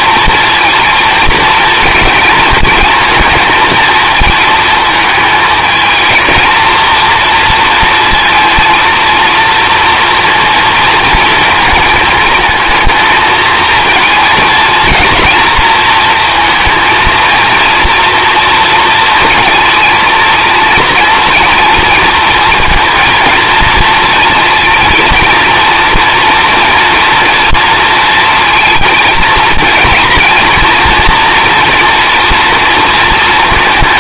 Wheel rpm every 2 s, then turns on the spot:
230, 230, 220, 230, 230, 230, 220, 220, 230, 230, 230, 230, 230, 230, 230, 230, 230.
none